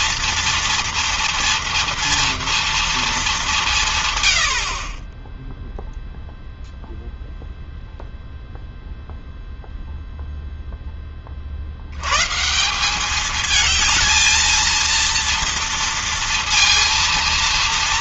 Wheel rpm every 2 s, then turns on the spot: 230, 230, 80, 0, 0, 0, 140, 220, 230.
none